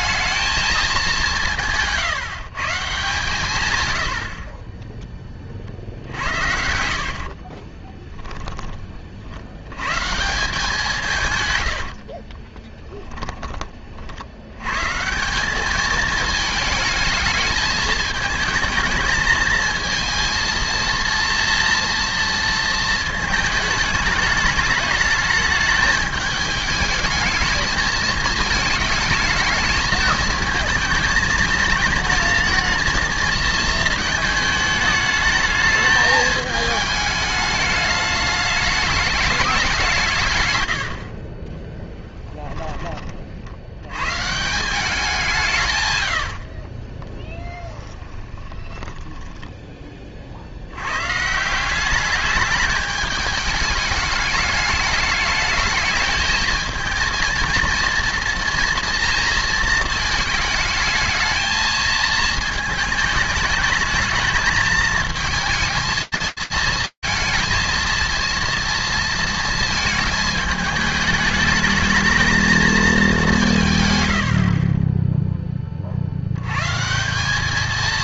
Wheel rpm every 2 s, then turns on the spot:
210, 150, 20, 80, 20, 170, 20, 110, 220, 220, 230, 230, 210, 210, 220, 220, 230, 220, 220, 210, 80, 20, 180, 30, 10, 80, 210, 210, 220, 230, 220, 220, 220, 230, 230, 210, 190, 20, 190.
6-8 12-14 40-42 46-50